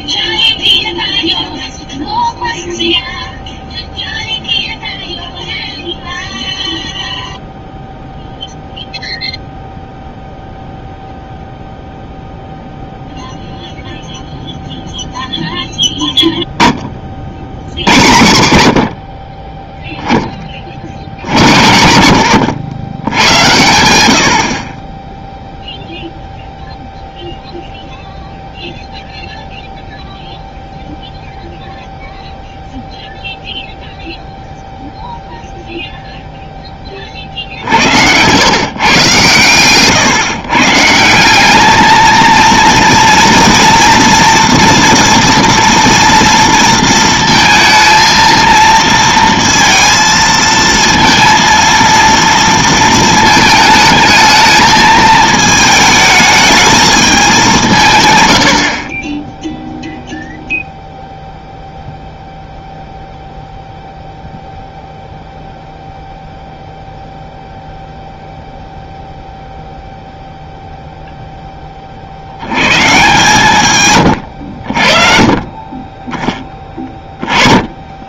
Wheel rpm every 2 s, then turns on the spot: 0, 0, 0, 0, 0, 0, 0, 0, 10, 90, 30, 90, 50, 0, 0, 0, 0, 0, 10, 130, 140, 230, 240, 230, 230, 230, 230, 220, 220, 70, 0, 0, 0, 0, 0, 0, 90, 70, 10.
none